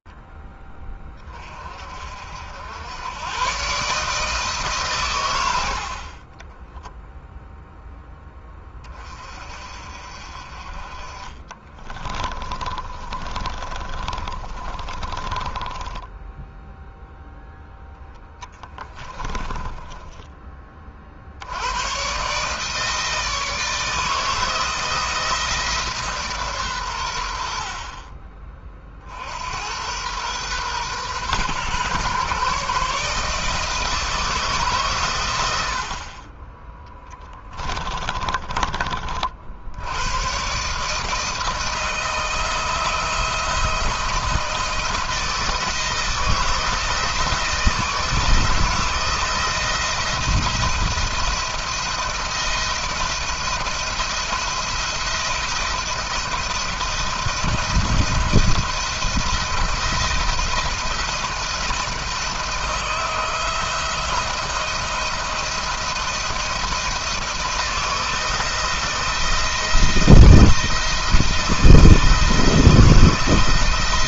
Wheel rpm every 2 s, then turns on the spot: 30, 100, 130, 10, 20, 40, 30, 30, 0, 10, 30, 150, 160, 120, 40, 120, 150, 140, 20, 30, 130, 160, 160, 160, 160, 170, 170, 170, 170, 170, 170, 170, 170, 170, 160, 160, 170.
6-8 12-16 18-20 38-40